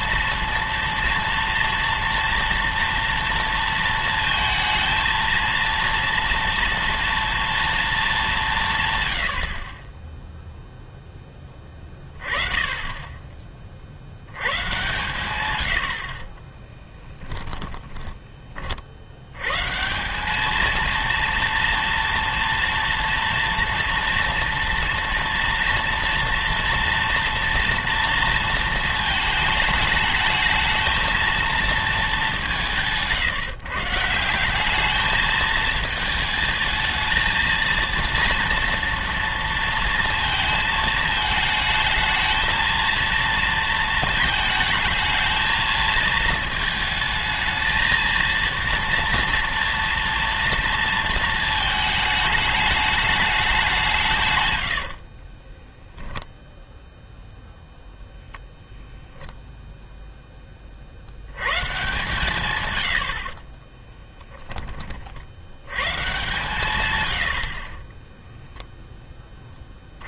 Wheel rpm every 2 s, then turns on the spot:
230, 230, 230, 230, 160, 0, 30, 130, 20, 40, 220, 240, 240, 230, 230, 220, 180, 200, 220, 240, 220, 230, 220, 220, 230, 230, 210, 90, 0, 0, 30, 130, 20, 130, 0.
16-18